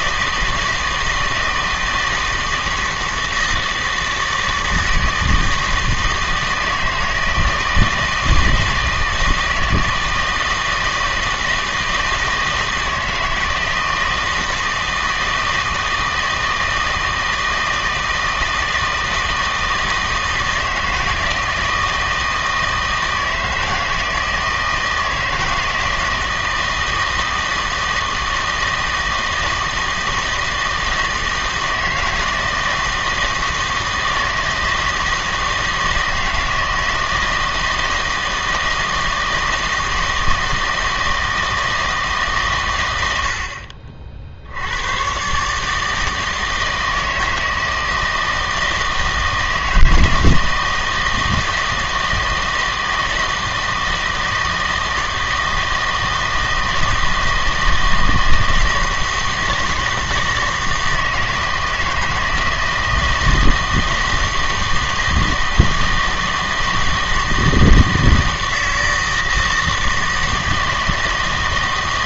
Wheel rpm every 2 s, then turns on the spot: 160, 160, 160, 160, 160, 160, 160, 160, 160, 160, 160, 160, 160, 160, 160, 160, 160, 160, 160, 160, 160, 110, 90, 160, 160, 160, 160, 160, 160, 160, 160, 160, 160, 160, 160, 160.
none